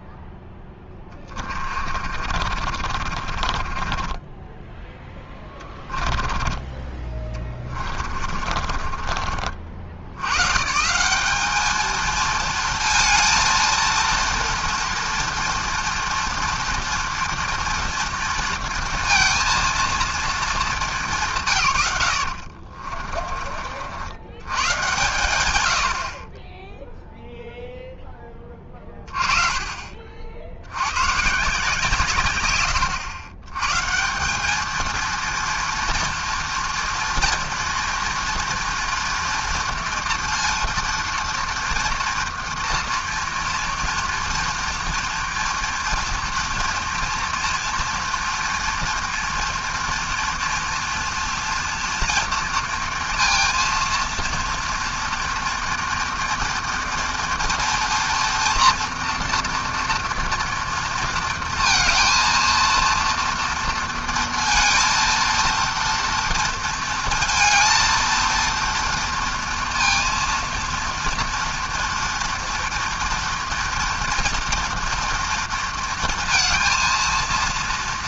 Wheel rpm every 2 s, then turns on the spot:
10, 50, 10, 20, 30, 130, 220, 230, 230, 230, 220, 60, 110, 20, 20, 90, 110, 200, 230, 230, 230, 230, 230, 230, 240, 240, 230, 230, 230, 240, 230, 230, 230, 230, 230, 230, 230, 230, 230.
0-4 6-10 22-24